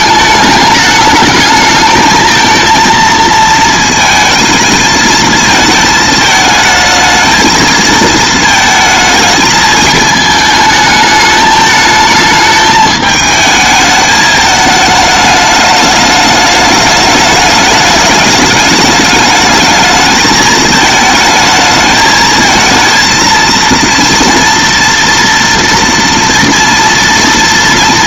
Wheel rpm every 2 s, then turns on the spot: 220, 220, 220, 220, 220, 220, 220, 220, 210, 210, 220, 220, 230, 230.
none